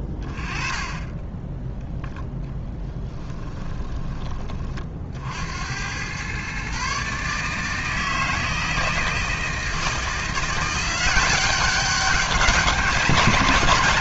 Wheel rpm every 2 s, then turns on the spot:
20, 10, 30, 140, 160, 180, 190.
none